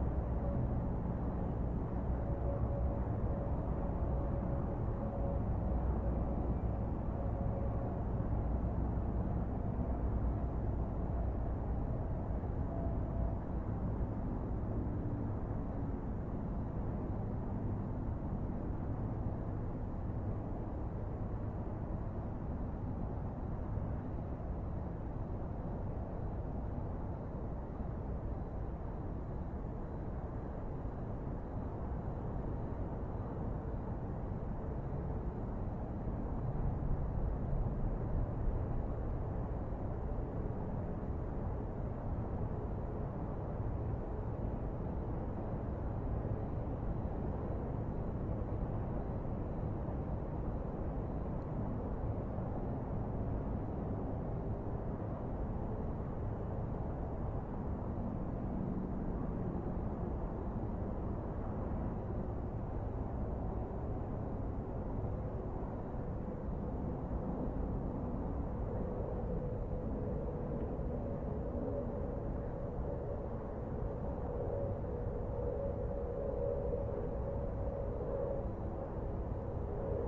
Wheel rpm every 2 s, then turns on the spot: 0, 0, 0, 0, 0, 0, 0, 0, 0, 0, 0, 0, 0, 0, 0, 0, 0, 0, 0, 0, 0, 0, 0, 0, 0, 0, 0, 0, 0, 0, 0, 0, 0, 0, 0, 0, 0, 0, 0, 0.
none